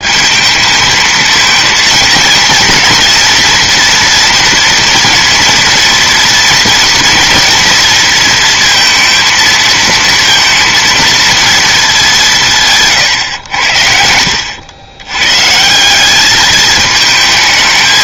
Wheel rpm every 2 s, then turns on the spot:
220, 240, 230, 230, 230, 230, 160, 100, 210.
12-14